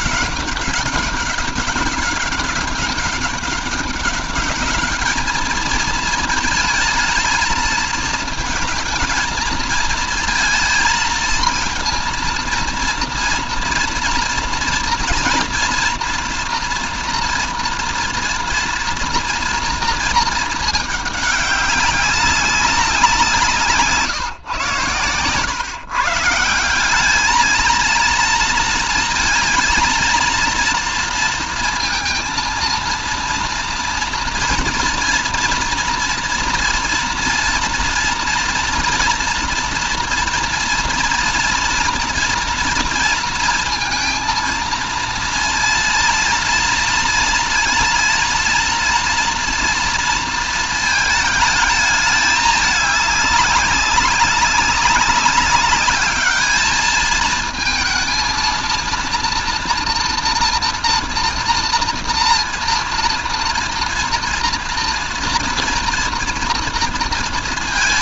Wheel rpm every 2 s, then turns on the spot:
200, 200, 210, 220, 230, 230, 240, 230, 230, 230, 210, 180, 130, 190, 230, 230, 230, 230, 230, 240, 230, 230, 230, 230, 230, 220, 200, 200, 220, 230, 230, 230, 230, 230.
none